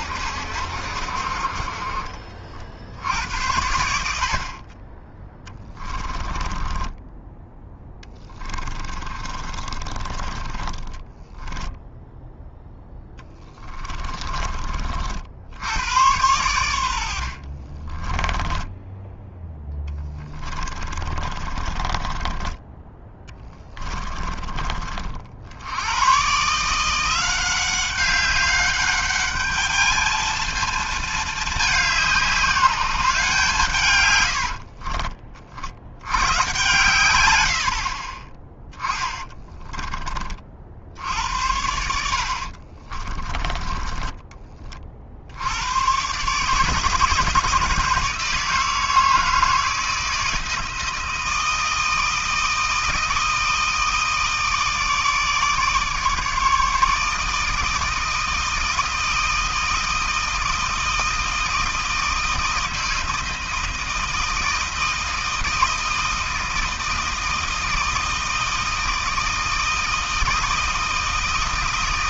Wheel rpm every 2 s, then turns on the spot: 70, 60, 30, 10, 20, 20, 0, 30, 90, 10, 20, 20, 40, 150, 200, 220, 190, 50, 110, 10, 50, 40, 30, 160, 170, 160, 160, 160, 150, 160, 160, 160, 160, 160, 160, 160.
6-12 18-22 34-36 38-40 42-44